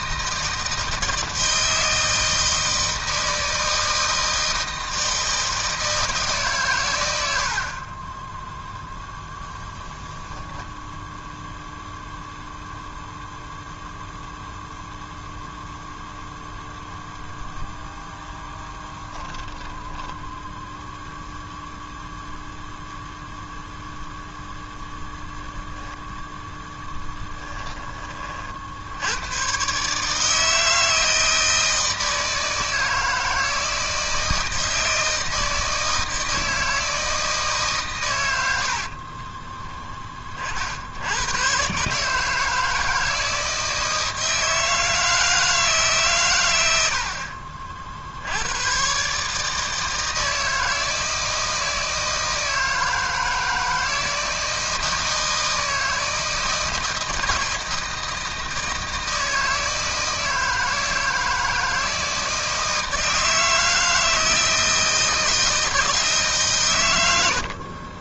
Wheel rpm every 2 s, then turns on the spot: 160, 160, 160, 150, 10, 10, 0, 0, 0, 10, 10, 0, 0, 0, 40, 160, 160, 160, 160, 100, 40, 160, 160, 110, 90, 160, 160, 160, 160, 160, 160, 160, 160, 150.
8-10 20-22 38-40